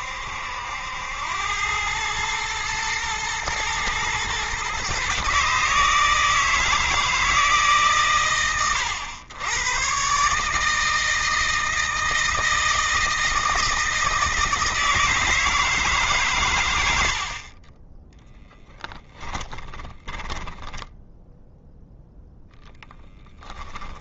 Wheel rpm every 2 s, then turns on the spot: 90, 110, 130, 160, 110, 160, 160, 160, 110, 10, 10, 10.
18-20